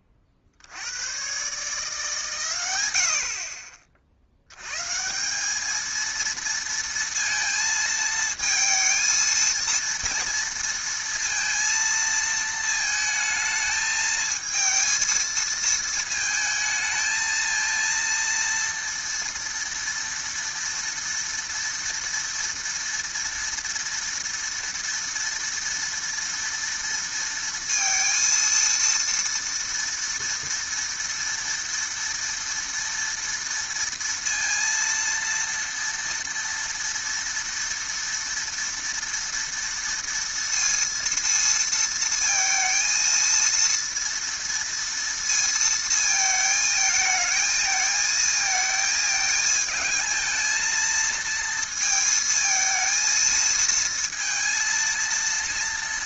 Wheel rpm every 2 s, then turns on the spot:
60, 140, 80, 230, 220, 230, 220, 220, 220, 230, 230, 240, 240, 230, 230, 230, 230, 230, 230, 230, 230, 230, 230, 220, 220, 220, 220, 230.
none